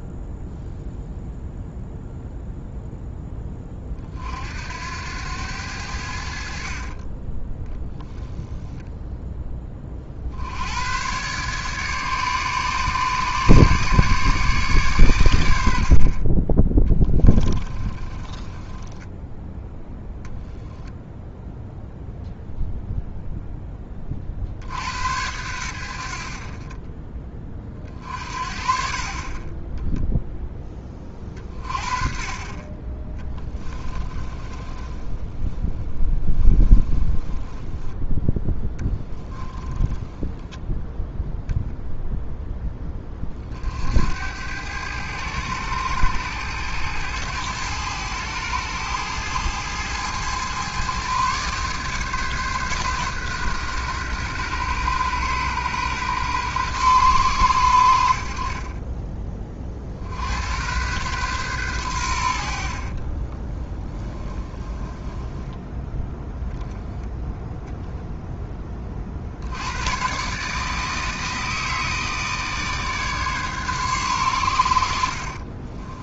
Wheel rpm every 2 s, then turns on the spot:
0, 0, 80, 40, 0, 110, 150, 130, 10, 10, 0, 0, 80, 30, 50, 20, 30, 20, 10, 10, 0, 10, 100, 110, 110, 120, 130, 120, 120, 30, 110, 40, 20, 10, 20, 160, 150, 80.
6-8 16-20 34-40 58-60 62-66